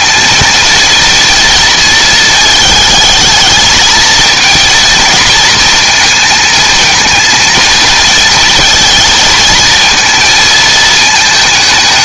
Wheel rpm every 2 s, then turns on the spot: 230, 220, 230, 220, 230, 220.
none